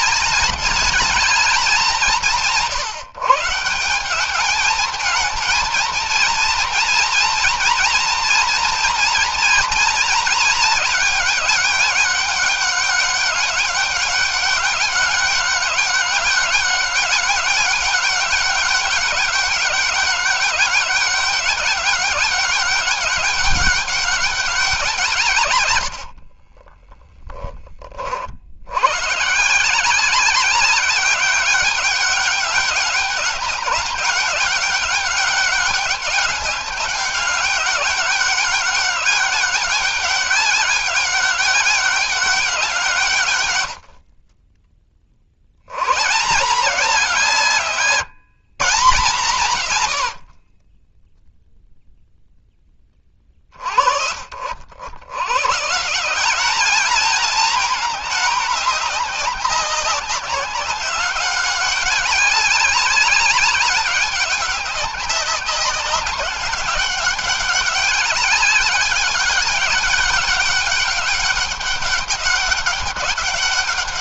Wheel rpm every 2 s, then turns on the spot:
210, 160, 220, 240, 230, 200, 200, 200, 200, 200, 200, 200, 160, 20, 110, 190, 190, 200, 200, 200, 190, 150, 40, 170, 150, 10, 30, 90, 220, 200, 200, 190, 200, 190, 200, 200, 200.
26-28